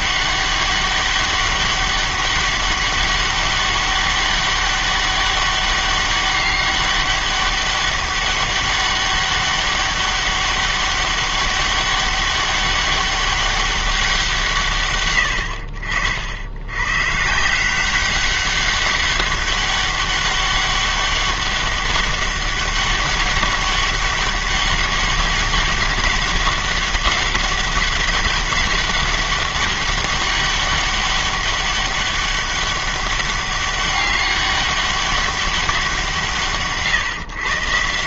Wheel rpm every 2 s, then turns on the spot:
200, 200, 200, 200, 200, 200, 200, 140, 90, 200, 200, 200, 200, 200, 200, 200, 200, 200, 140.
none